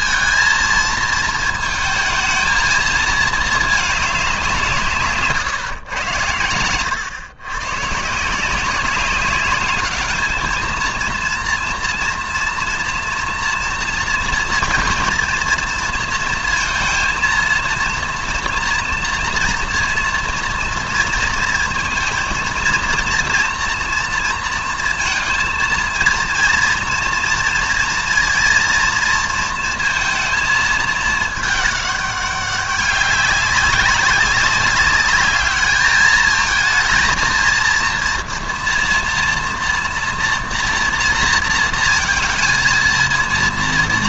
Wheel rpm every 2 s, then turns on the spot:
230, 220, 170, 110, 190, 220, 240, 230, 230, 230, 230, 230, 230, 230, 230, 220, 190, 200, 220, 230, 230, 230.
none